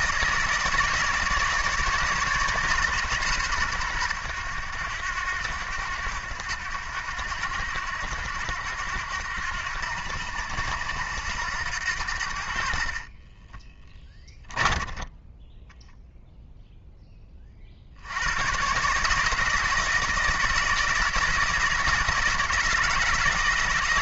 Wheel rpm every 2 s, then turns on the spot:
160, 140, 90, 90, 90, 90, 40, 10, 10, 140, 160, 160.
12-16